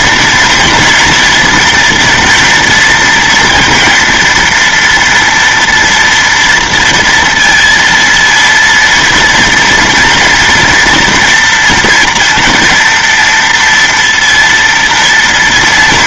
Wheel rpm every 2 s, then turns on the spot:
230, 230, 230, 230, 230, 230, 230, 230.
none